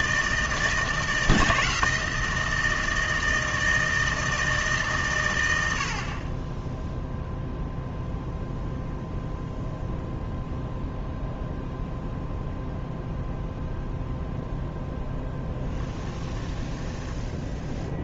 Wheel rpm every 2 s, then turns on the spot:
160, 160, 130, 0, 0, 0, 0, 10, 10.
16-18